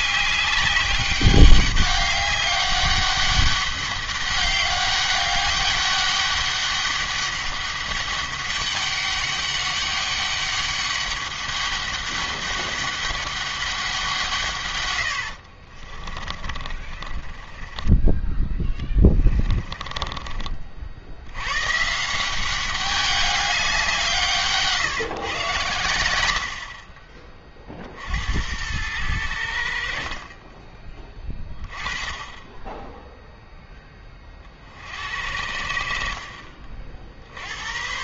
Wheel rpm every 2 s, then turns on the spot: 200, 200, 200, 200, 200, 200, 200, 120, 40, 10, 50, 200, 150, 40, 100, 20, 10, 60, 50.
16-20